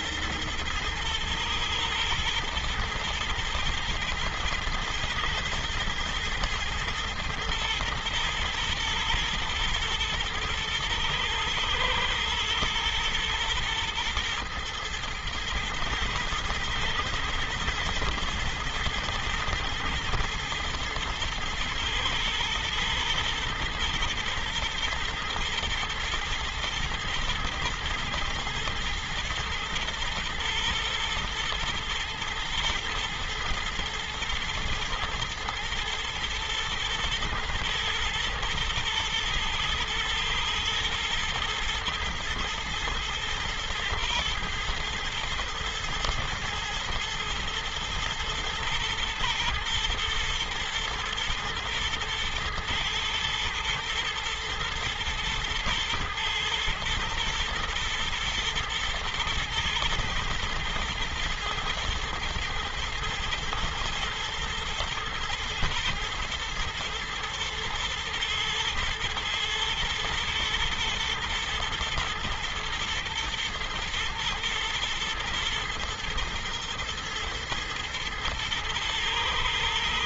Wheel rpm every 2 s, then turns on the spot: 120, 110, 120, 120, 120, 110, 120, 120, 120, 120, 110, 110, 110, 110, 110, 120, 120, 110, 120, 120, 110, 110, 110, 120, 110, 110, 110, 110, 110, 120, 120, 120, 120, 120, 110, 110, 110, 120, 110, 120.
none